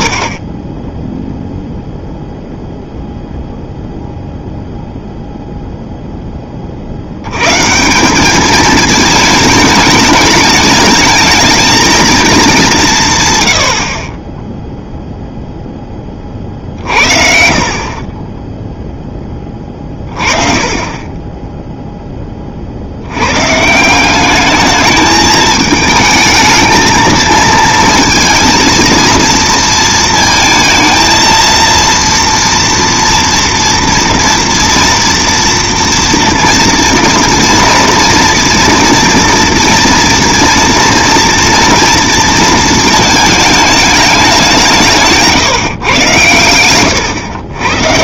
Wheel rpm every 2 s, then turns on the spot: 0, 0, 0, 110, 220, 220, 90, 0, 50, 10, 20, 80, 220, 220, 230, 230, 230, 230, 230, 230, 230, 220, 170, 110.
none